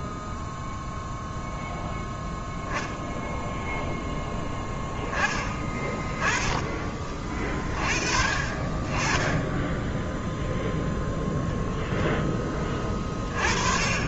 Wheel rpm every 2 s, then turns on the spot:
0, 0, 10, 20, 20, 0, 20.
none